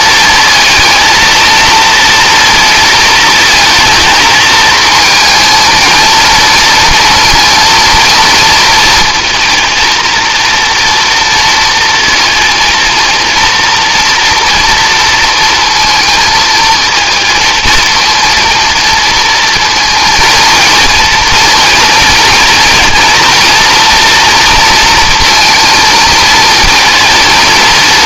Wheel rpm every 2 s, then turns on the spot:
230, 230, 220, 230, 230, 230, 230, 230, 230, 230, 230, 230, 230, 230.
none